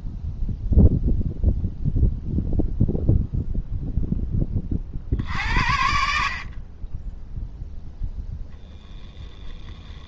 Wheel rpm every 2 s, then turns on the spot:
0, 0, 30, 50, 0.
none